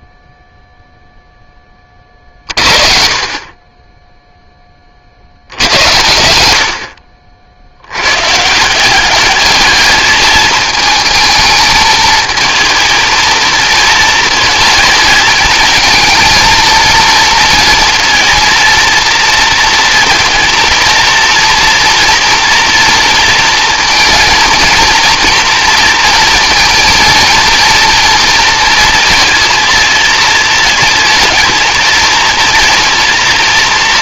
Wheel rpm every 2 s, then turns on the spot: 0, 40, 50, 70, 200, 220, 230, 220, 230, 230, 230, 230, 230, 230, 230, 230, 230.
none